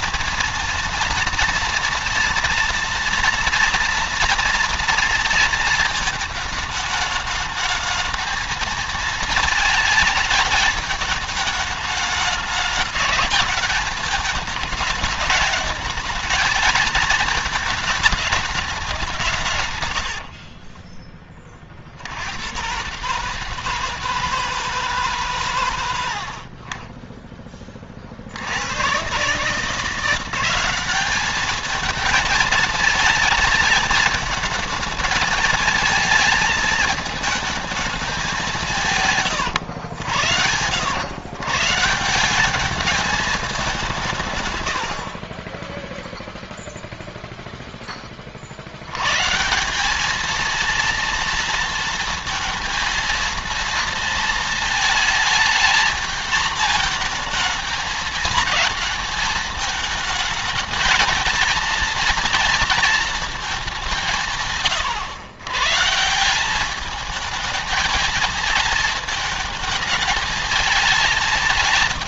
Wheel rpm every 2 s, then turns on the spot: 230, 240, 230, 220, 220, 210, 210, 210, 220, 190, 30, 130, 150, 40, 110, 200, 220, 220, 220, 140, 110, 210, 80, 0, 110, 230, 230, 220, 230, 220, 220, 230, 120, 210, 220, 220.
20-22